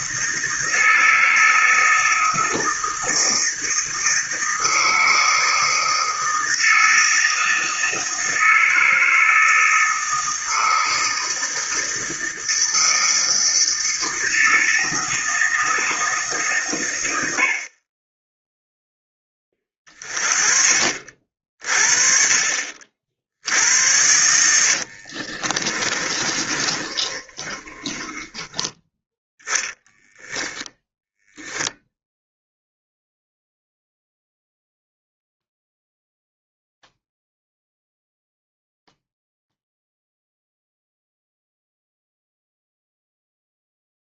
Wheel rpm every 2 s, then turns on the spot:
160, 160, 160, 160, 160, 160, 160, 160, 130, 0, 40, 50, 80, 30, 20, 10, 0, 0, 0, 0, 0, 0.
24-28 30-32